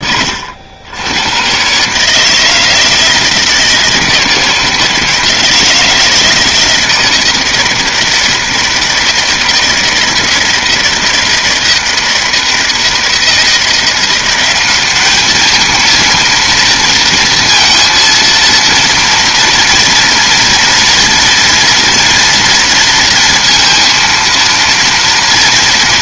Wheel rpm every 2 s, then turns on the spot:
70, 160, 160, 160, 160, 160, 160, 190, 230, 230, 240, 230, 230.
none